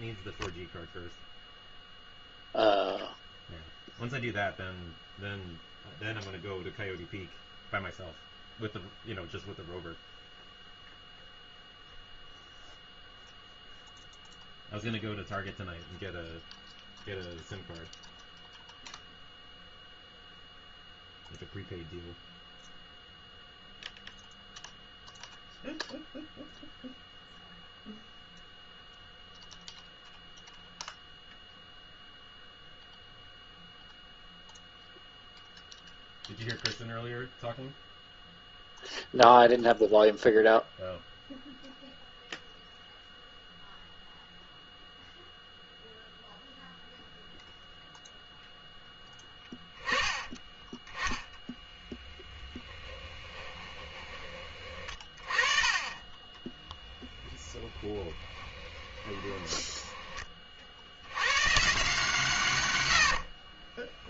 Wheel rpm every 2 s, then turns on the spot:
0, 0, 0, 0, 0, 0, 0, 0, 0, 0, 0, 0, 0, 0, 0, 0, 0, 0, 0, 0, 0, 0, 0, 0, 0, 10, 10, 30, 10, 20, 60, 120.
52-54 56-60